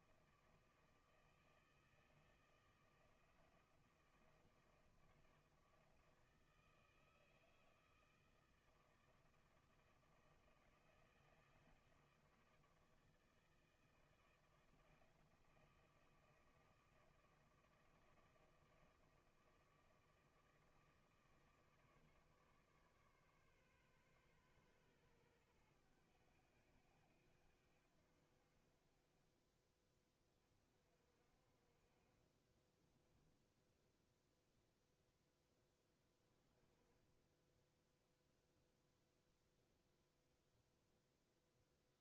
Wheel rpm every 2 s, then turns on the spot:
160, 160, 160, 160, 160, 160, 160, 160, 160, 160, 160, 140, 120, 90, 40, 40, 20, 0, 20, 0, 0.
32-34